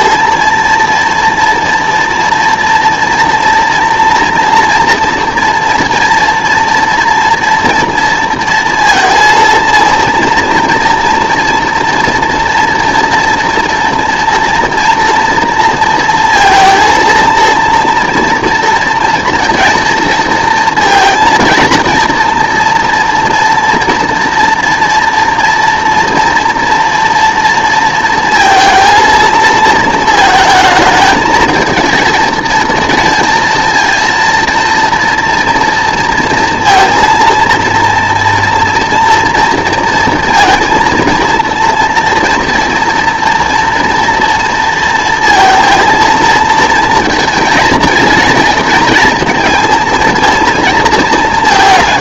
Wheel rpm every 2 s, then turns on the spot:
230, 230, 230, 230, 230, 230, 230, 240, 230, 230, 230, 230, 230, 240, 230, 220, 230, 230, 230, 240, 230, 230, 230, 230, 230, 230.
none